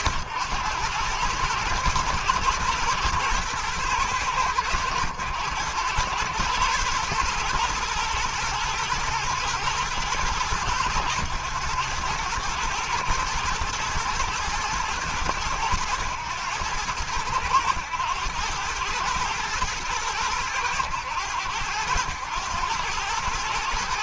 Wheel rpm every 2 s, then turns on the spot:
110, 120, 100, 120, 120, 110, 120, 110, 100, 110, 100, 110.
none